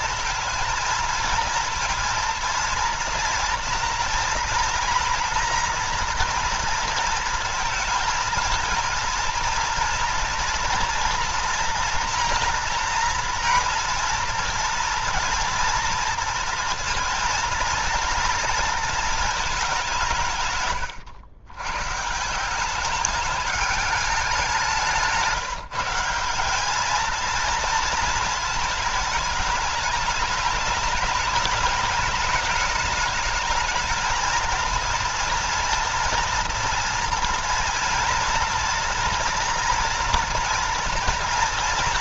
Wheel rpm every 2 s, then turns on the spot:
230, 230, 230, 230, 220, 240, 230, 230, 230, 230, 120, 200, 170, 220, 220, 210, 220, 230, 230, 230, 230.
20-22